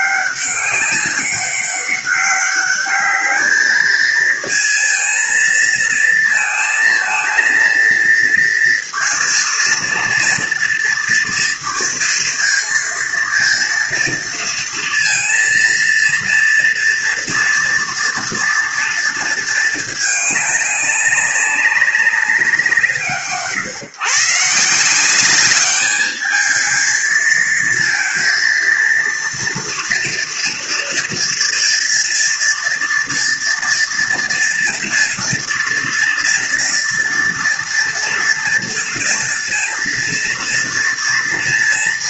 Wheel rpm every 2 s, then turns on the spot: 200, 200, 230, 230, 230, 230, 230, 230, 230, 230, 210, 180, 160, 220, 230, 230, 230, 230, 230, 230, 230.
none